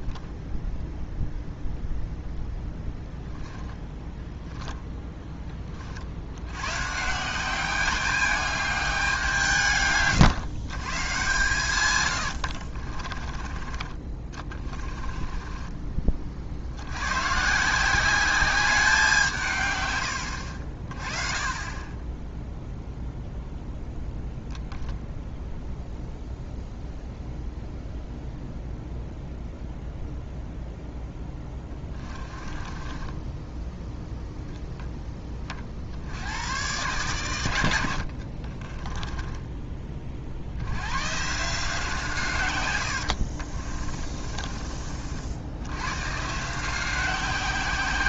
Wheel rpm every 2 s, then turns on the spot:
0, 0, 10, 150, 200, 130, 40, 20, 90, 190, 40, 0, 0, 0, 0, 0, 30, 10, 120, 20, 100, 100, 40, 180.
12-16 32-34 38-40 42-44